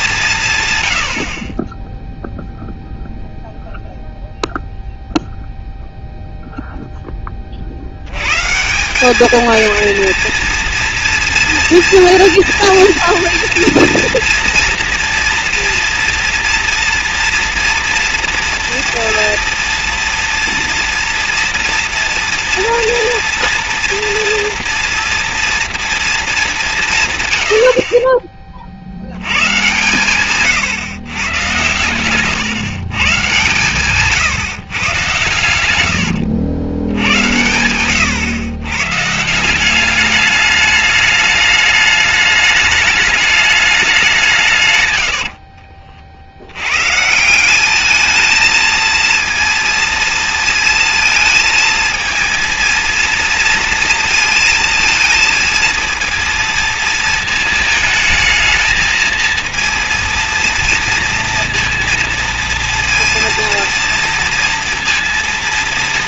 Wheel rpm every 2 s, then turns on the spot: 150, 0, 0, 0, 160, 230, 230, 230, 240, 240, 230, 230, 230, 190, 30, 130, 130, 140, 90, 110, 210, 210, 150, 90, 220, 230, 230, 230, 230, 220, 230, 230, 230.
none